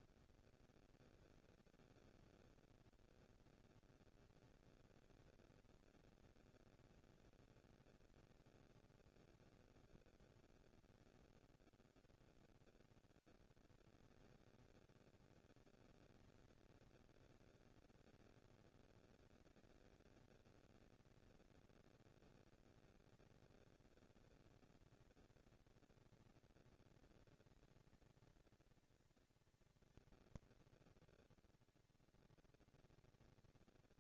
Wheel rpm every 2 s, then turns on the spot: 230, 240, 240, 230, 220, 170, 100, 190, 210, 230, 230, 230, 220, 230, 230, 230, 220.
none